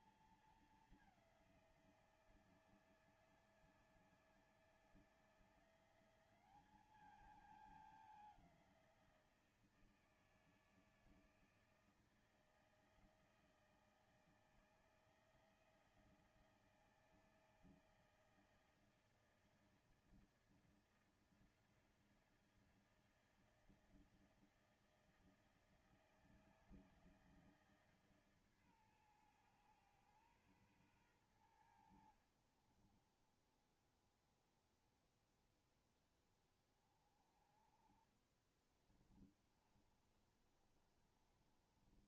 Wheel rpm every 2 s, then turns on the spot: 210, 160, 160, 210, 180, 160, 160, 160, 160, 160, 160, 160, 160, 160, 130, 120, 40, 20, 30, 30, 30.
38-42